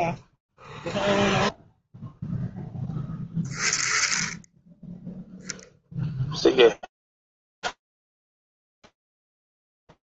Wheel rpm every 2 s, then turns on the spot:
20, 0, 0, 30, 10.
none